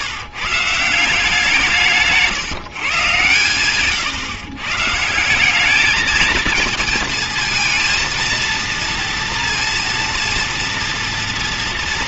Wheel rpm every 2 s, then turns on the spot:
150, 150, 140, 220, 230, 230.
none